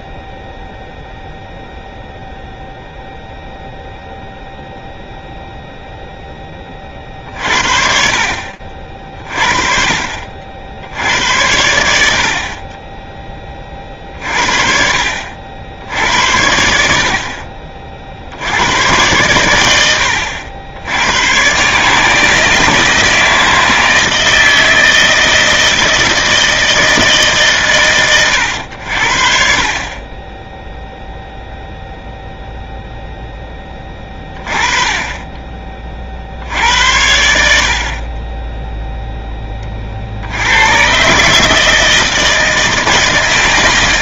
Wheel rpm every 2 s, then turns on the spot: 0, 0, 20, 60, 70, 30, 50, 90, 80, 80, 160, 160, 160, 100, 20, 0, 20, 50, 40, 50, 160, 160.
none